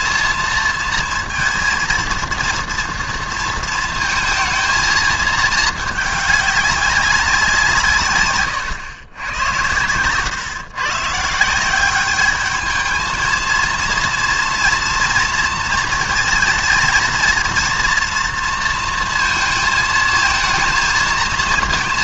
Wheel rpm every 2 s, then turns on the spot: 230, 230, 220, 200, 110, 130, 220, 240, 230, 230, 230.
none